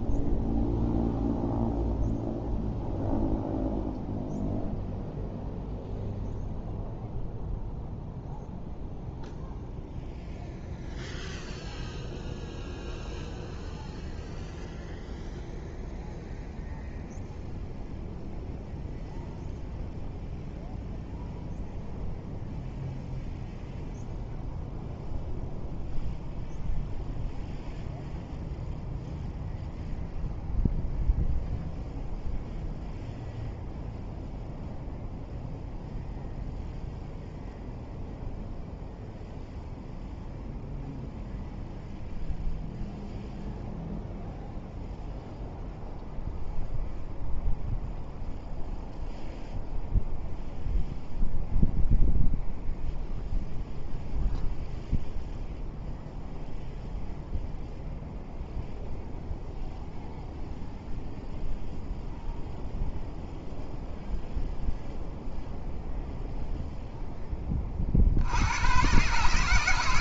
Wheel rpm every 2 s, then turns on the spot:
0, 0, 0, 0, 0, 0, 0, 0, 0, 0, 0, 0, 0, 0, 0, 0, 0, 0, 0, 0, 0, 0, 0, 0, 0, 0, 0, 0, 0, 0, 0, 0, 0, 0, 90.
none